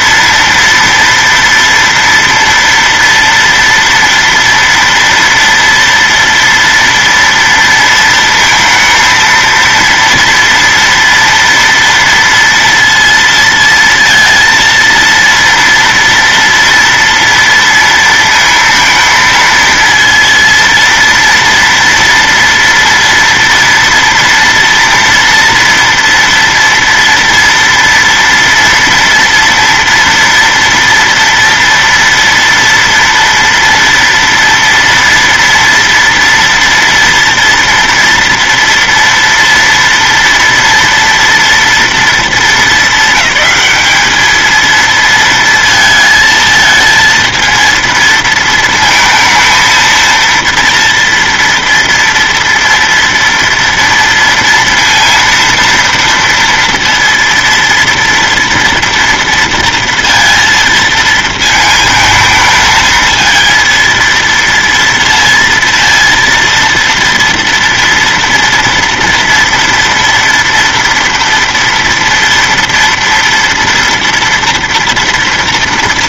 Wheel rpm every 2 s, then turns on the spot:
230, 230, 230, 230, 230, 230, 230, 230, 230, 230, 230, 230, 230, 230, 240, 240, 230, 230, 230, 230, 230, 200, 220, 220, 230, 230, 230, 230, 230, 230, 230, 220, 230, 230, 230, 230, 230, 240.
none